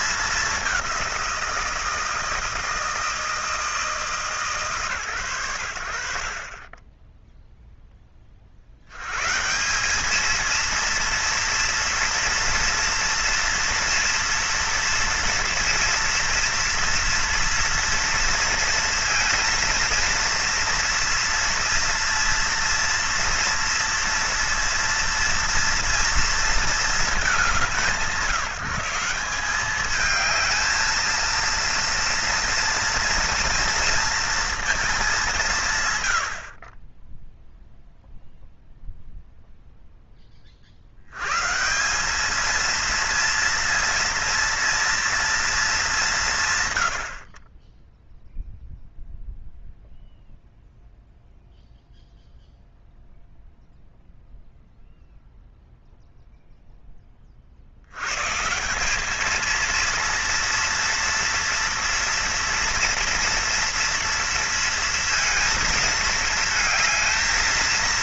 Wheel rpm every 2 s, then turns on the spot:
200, 160, 130, 30, 70, 230, 230, 230, 230, 230, 230, 230, 230, 220, 180, 220, 230, 230, 40, 0, 60, 230, 230, 130, 0, 0, 0, 0, 0, 160, 230, 240, 230, 220.
none